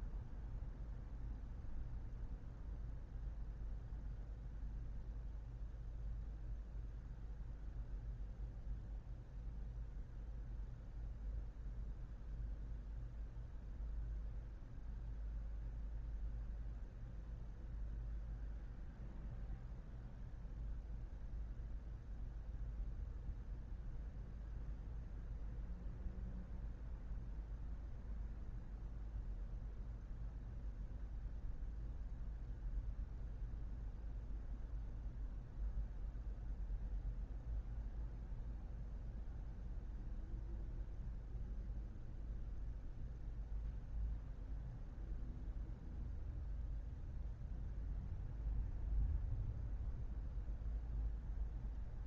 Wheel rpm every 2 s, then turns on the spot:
0, 0, 0, 0, 0, 0, 0, 0, 0, 0, 0, 0, 0, 0, 0, 0, 0, 0, 0, 0, 0, 0, 0, 0, 0, 0.
none